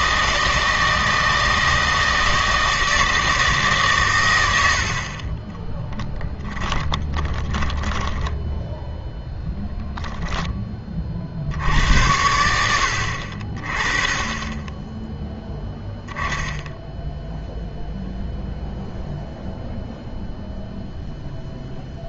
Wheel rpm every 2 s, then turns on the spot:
160, 170, 80, 10, 0, 10, 80, 20, 0, 0, 0.
4-8